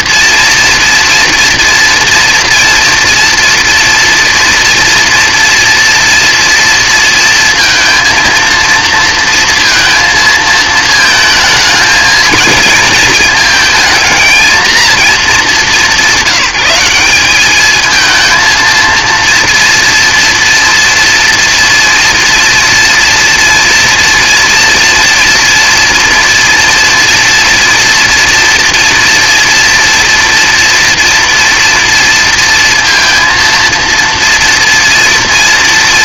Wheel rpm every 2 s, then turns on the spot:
240, 240, 230, 230, 230, 220, 220, 220, 180, 230, 230, 240, 240, 240, 240, 240, 230, 230.
none